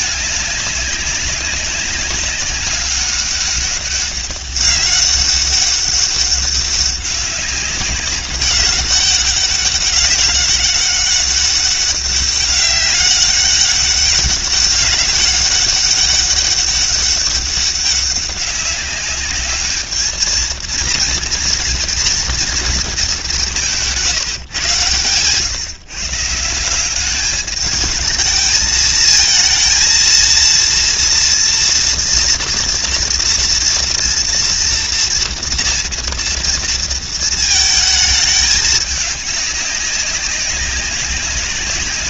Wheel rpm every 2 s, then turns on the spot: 200, 200, 200, 200, 200, 200, 200, 200, 200, 200, 230, 210, 130, 200, 220, 230, 230, 230, 230, 210, 200.
none